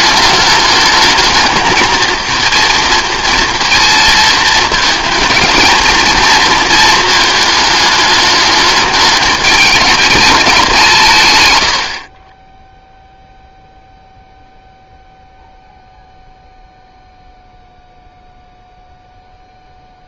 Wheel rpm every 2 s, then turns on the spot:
210, 230, 220, 220, 210, 180, 0, 0, 0, 0.
none